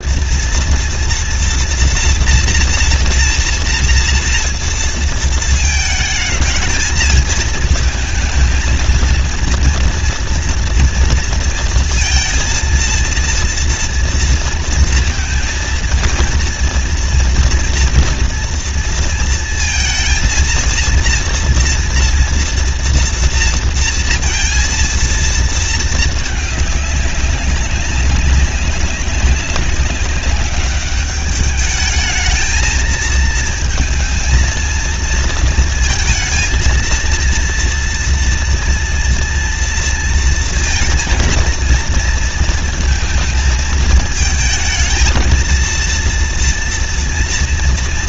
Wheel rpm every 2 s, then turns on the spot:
230, 230, 230, 220, 230, 240, 230, 230, 230, 230, 230, 240, 230, 210, 190, 200, 220, 230, 230, 230, 230, 230, 220, 230.
none